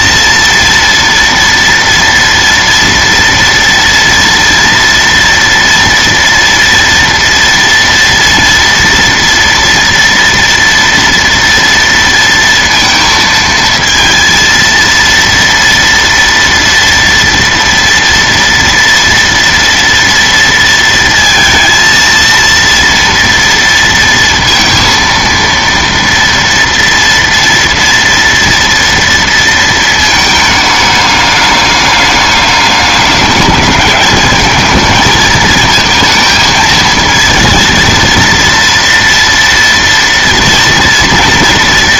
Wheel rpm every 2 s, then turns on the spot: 230, 240, 230, 230, 230, 240, 230, 230, 230, 230, 230, 230, 230, 230, 230, 210, 200, 220, 220, 230, 240.
none